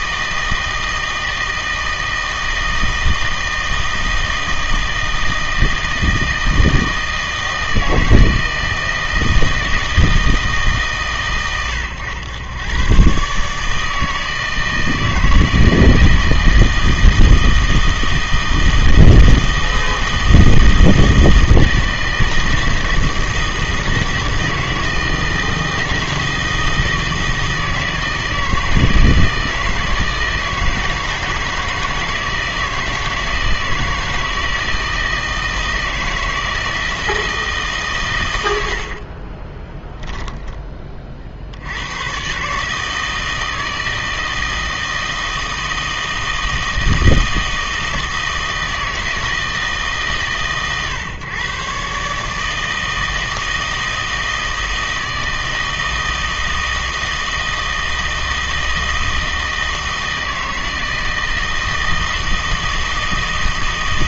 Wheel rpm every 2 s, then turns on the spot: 160, 160, 160, 160, 160, 150, 110, 160, 160, 160, 160, 160, 160, 160, 160, 160, 160, 160, 160, 80, 10, 150, 160, 160, 160, 140, 160, 160, 160, 160, 160, 160.
none